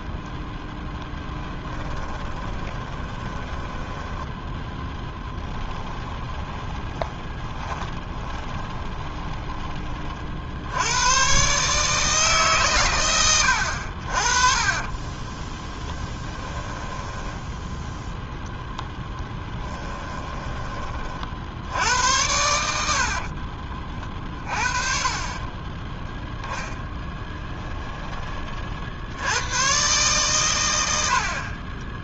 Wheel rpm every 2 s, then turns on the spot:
10, 20, 10, 20, 20, 80, 120, 30, 10, 0, 30, 70, 30, 20, 50, 90.
2-4 6-10 14-18 26-28